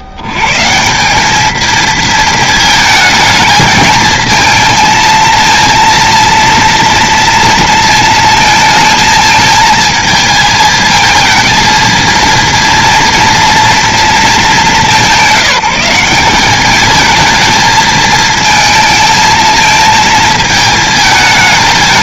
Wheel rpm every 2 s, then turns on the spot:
90, 220, 220, 230, 220, 220, 230, 210, 200, 220, 220.
none